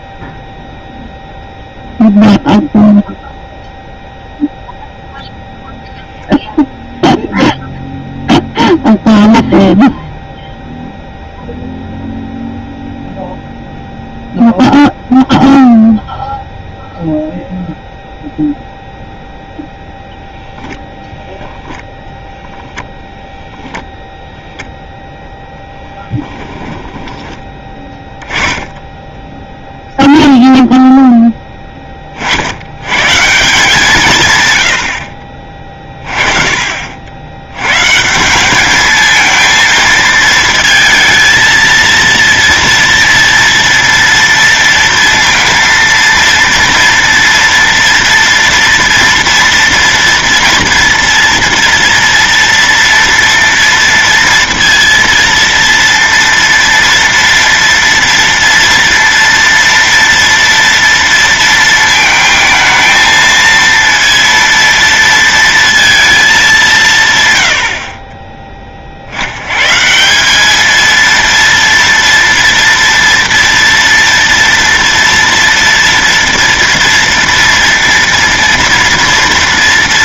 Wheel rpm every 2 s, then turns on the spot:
0, 0, 0, 0, 0, 0, 0, 0, 0, 0, 0, 10, 0, 20, 10, 0, 100, 90, 50, 200, 230, 230, 230, 230, 230, 230, 230, 230, 230, 230, 230, 220, 230, 170, 40, 220, 240, 230, 230, 230.
26-28